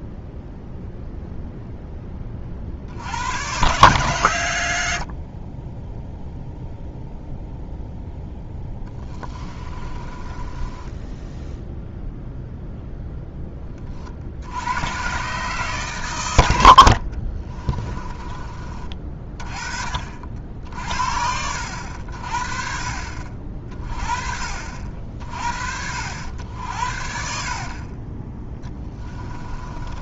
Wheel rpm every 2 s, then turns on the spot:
0, 60, 80, 0, 10, 10, 0, 110, 60, 30, 50, 40, 50, 70, 10.
4-6 8-12 26-30